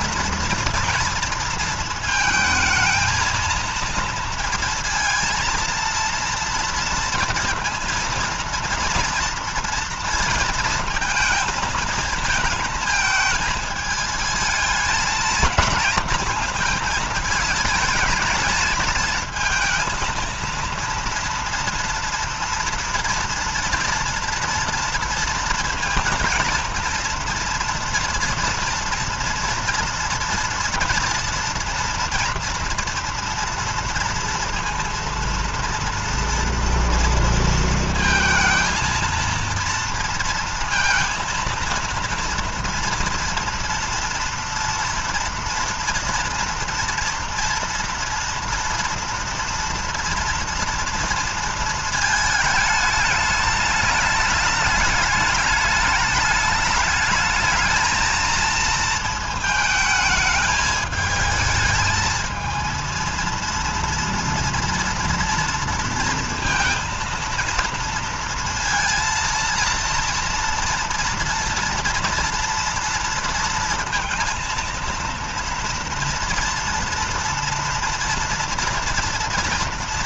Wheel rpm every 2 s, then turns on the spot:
230, 220, 230, 230, 230, 230, 220, 220, 220, 220, 230, 230, 230, 230, 230, 230, 230, 230, 230, 230, 230, 230, 240, 230, 230, 230, 220, 210, 210, 230, 220, 230, 230, 230, 230, 230, 230, 230, 230, 230.
none